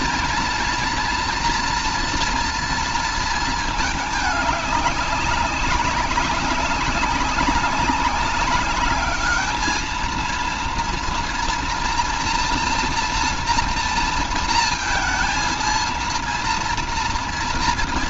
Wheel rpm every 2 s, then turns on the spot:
240, 230, 200, 200, 200, 230, 230, 230, 230.
none